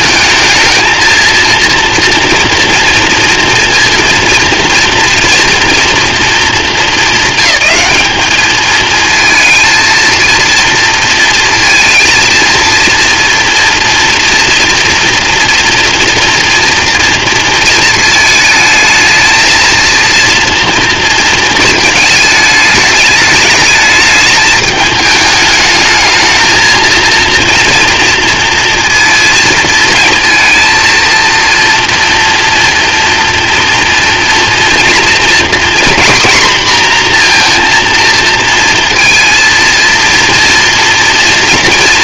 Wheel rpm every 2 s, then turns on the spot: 220, 230, 230, 210, 210, 230, 230, 230, 230, 220, 230, 210, 210, 220, 230, 230, 230, 230, 240, 230, 230.
none